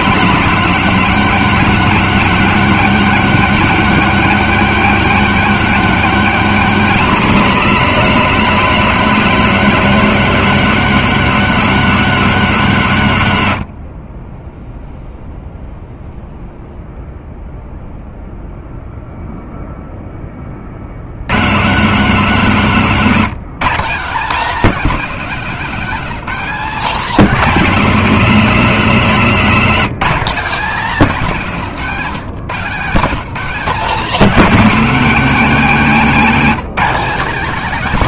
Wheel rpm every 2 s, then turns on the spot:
240, 240, 250, 230, 230, 230, 200, 0, 0, 0, 50, 200, 230, 240, 220, 220, 190, 250, 230.
none